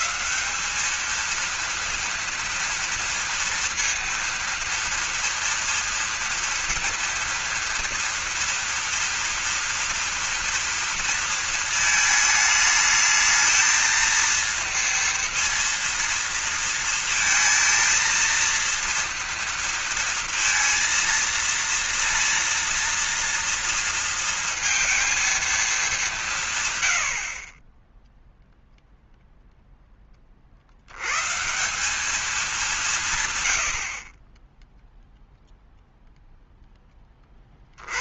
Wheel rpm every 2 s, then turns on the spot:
210, 230, 230, 230, 230, 230, 220, 230, 230, 230, 230, 230, 230, 130, 0, 70, 190, 10, 10.
none